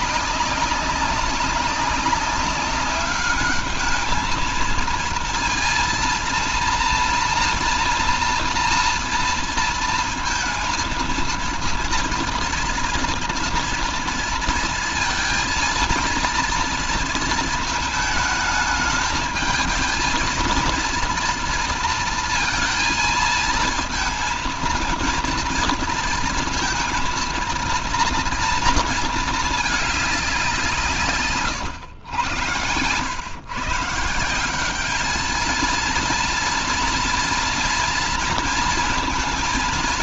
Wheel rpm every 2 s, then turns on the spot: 200, 190, 220, 230, 230, 220, 230, 230, 230, 220, 230, 230, 220, 230, 230, 170, 100, 190, 230, 230.
none